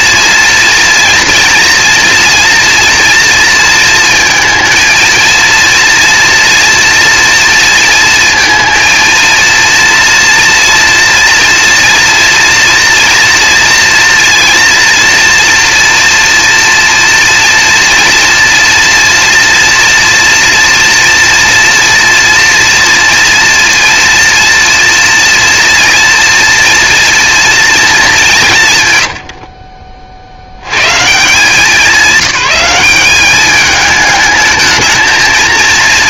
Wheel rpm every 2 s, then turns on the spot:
240, 230, 230, 230, 230, 230, 230, 230, 240, 230, 230, 230, 230, 230, 140, 130, 190, 220.
none